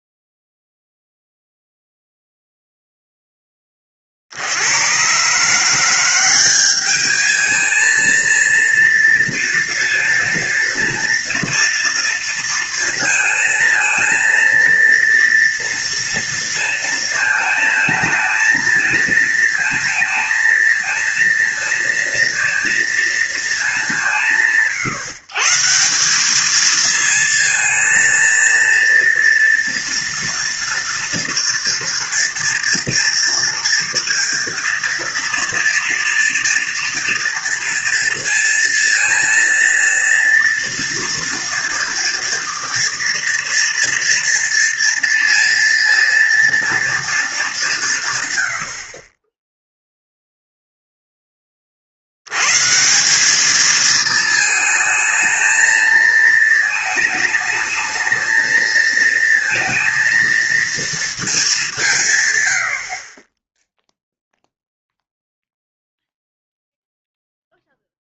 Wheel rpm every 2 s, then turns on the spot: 0, 0, 70, 200, 230, 230, 230, 230, 230, 230, 230, 230, 120, 210, 230, 230, 230, 230, 230, 230, 230, 230, 230, 230, 80, 0, 110, 220, 220, 220, 230, 100, 0, 0.
none